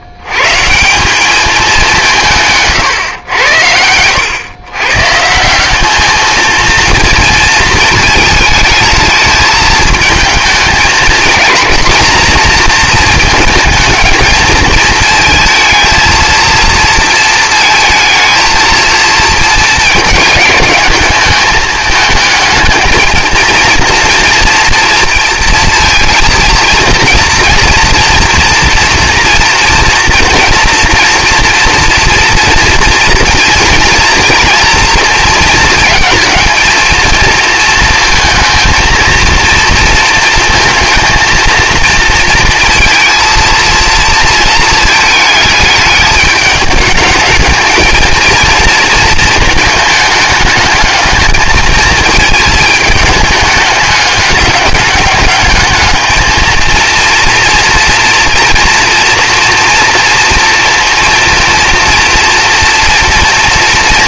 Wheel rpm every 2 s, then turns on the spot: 140, 150, 130, 230, 220, 220, 230, 220, 230, 230, 210, 220, 230, 230, 230, 230, 230, 230, 220, 230, 230, 230, 220, 210, 230, 220, 220, 210, 220, 230, 230, 230.
none